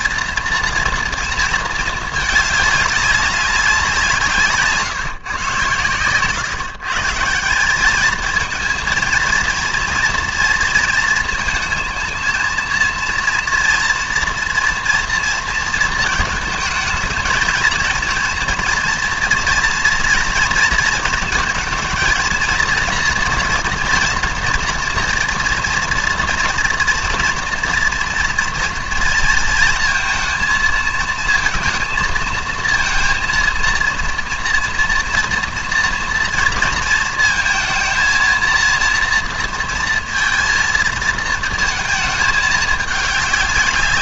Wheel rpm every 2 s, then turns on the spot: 230, 200, 140, 150, 230, 230, 230, 230, 220, 230, 230, 230, 230, 230, 230, 230, 230, 240, 230, 230, 230, 210.
none